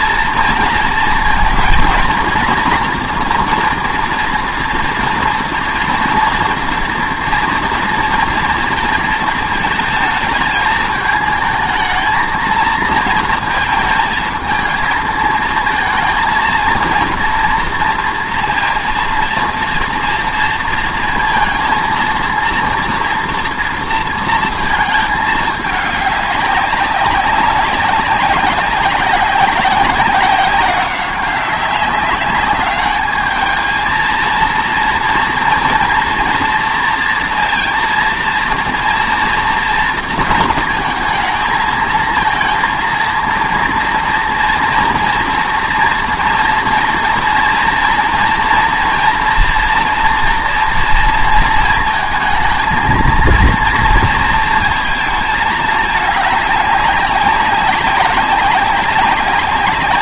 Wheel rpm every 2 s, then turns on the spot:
230, 240, 230, 230, 230, 220, 230, 220, 230, 230, 230, 230, 220, 200, 190, 190, 200, 230, 230, 230, 230, 230, 230, 230, 230, 240, 220, 220, 200, 190.
none